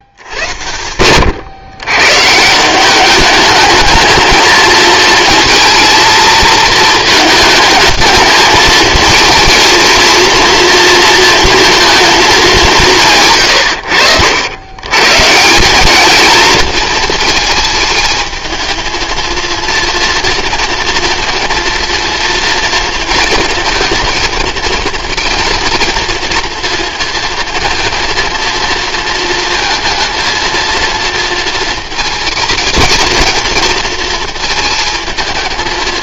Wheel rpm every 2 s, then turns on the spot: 100, 180, 220, 220, 220, 230, 190, 110, 230, 220, 230, 230, 230, 230, 230, 230, 230, 220.
none